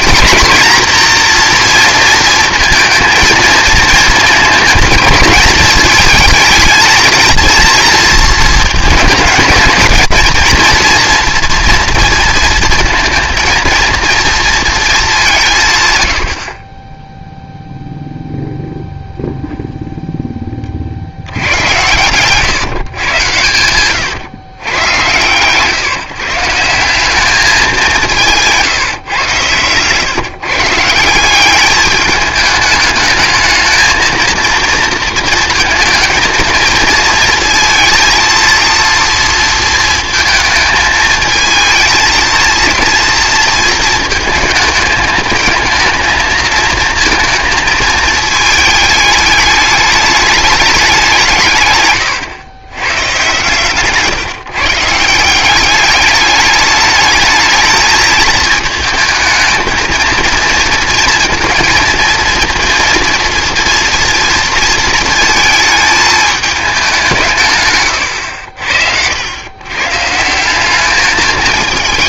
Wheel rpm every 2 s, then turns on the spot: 240, 230, 220, 230, 220, 230, 230, 230, 30, 0, 30, 130, 110, 170, 150, 150, 210, 230, 220, 230, 220, 230, 220, 230, 220, 200, 110, 150, 210, 220, 230, 230, 230, 210, 70, 190.
28-30